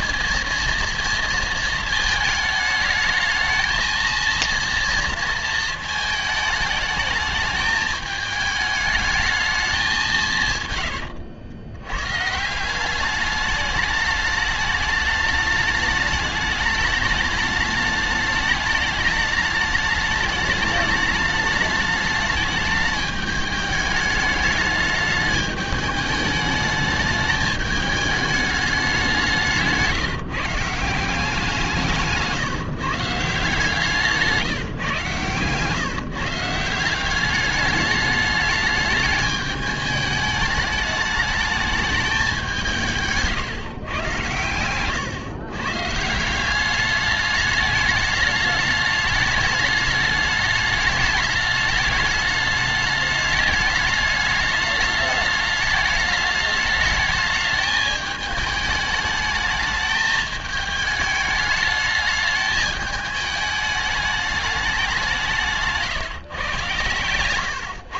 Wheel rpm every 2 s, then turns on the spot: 230, 220, 230, 210, 210, 130, 170, 210, 210, 210, 210, 210, 210, 210, 210, 160, 150, 160, 170, 210, 210, 180, 110, 200, 210, 210, 210, 210, 210, 220, 210, 210, 210, 130.
none